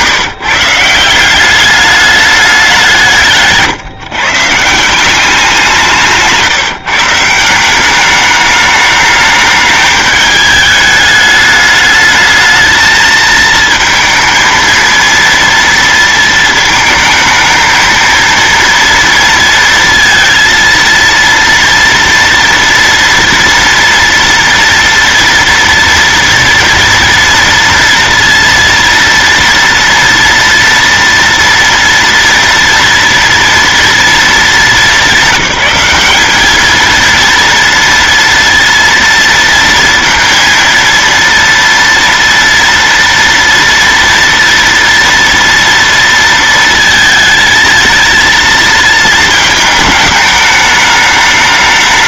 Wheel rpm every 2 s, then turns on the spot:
160, 190, 160, 160, 210, 210, 220, 230, 220, 230, 230, 230, 230, 240, 230, 230, 230, 210, 210, 230, 230, 230, 230, 230, 230, 210.
none